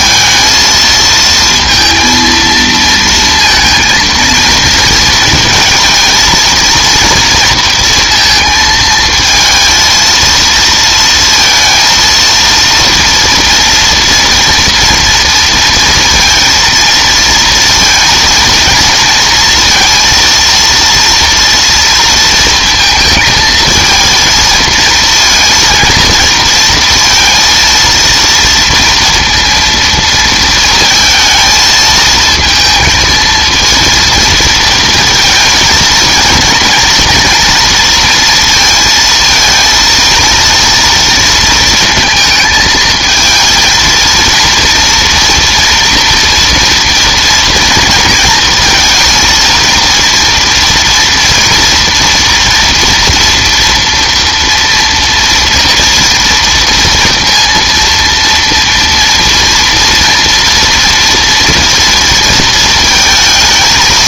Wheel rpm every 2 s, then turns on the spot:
230, 230, 230, 230, 220, 230, 230, 240, 230, 230, 230, 230, 230, 230, 230, 230, 220, 230, 230, 230, 230, 220, 230, 240, 220, 230, 240, 230, 230, 230, 230, 230.
none